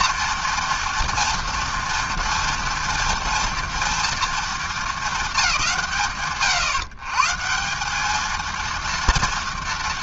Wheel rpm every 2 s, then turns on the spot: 240, 240, 230, 140, 230.
none